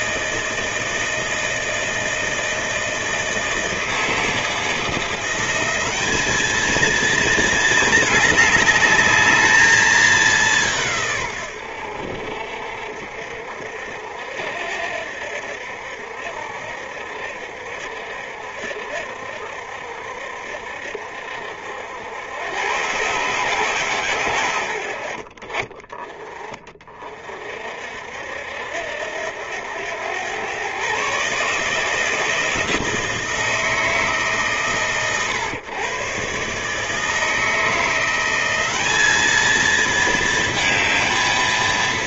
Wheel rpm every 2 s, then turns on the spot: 160, 160, 180, 220, 210, 120, 60, 70, 60, 60, 60, 120, 90, 30, 70, 120, 170, 120, 150, 200, 230.
none